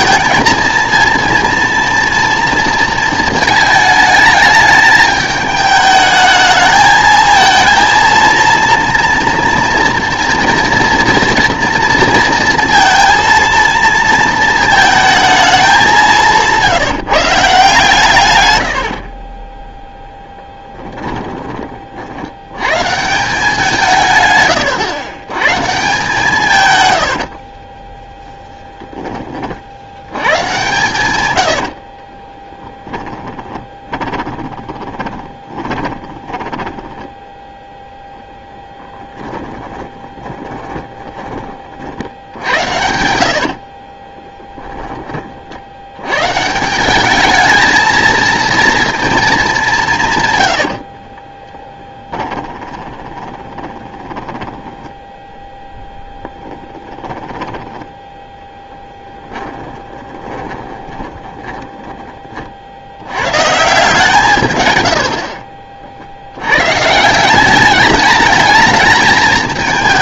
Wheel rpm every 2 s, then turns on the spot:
230, 230, 210, 220, 240, 230, 230, 220, 160, 80, 10, 110, 130, 120, 10, 130, 10, 20, 20, 0, 10, 80, 10, 170, 230, 80, 20, 10, 10, 10, 20, 70, 110, 130, 220.
18-22 30-38 40-44 50-62